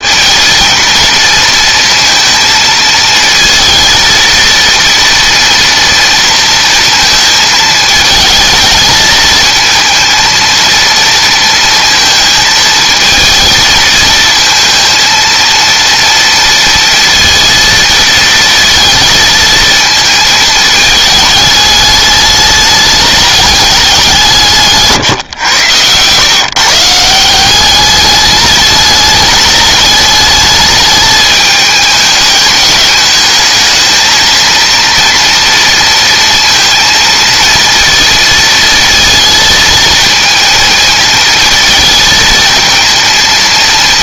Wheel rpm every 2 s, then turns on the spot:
220, 220, 230, 230, 220, 230, 220, 230, 230, 220, 220, 210, 150, 150, 220, 210, 220, 230, 230, 230, 220, 230.
none